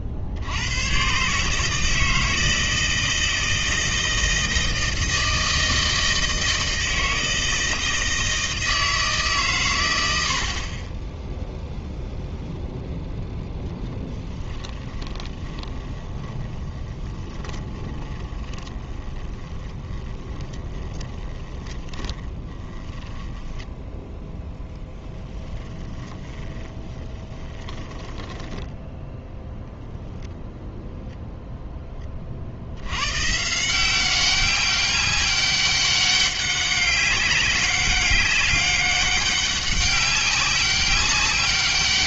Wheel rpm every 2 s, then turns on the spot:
80, 160, 160, 160, 160, 60, 0, 20, 20, 20, 20, 10, 10, 30, 10, 0, 60, 200, 190, 200, 190.
14-24 26-28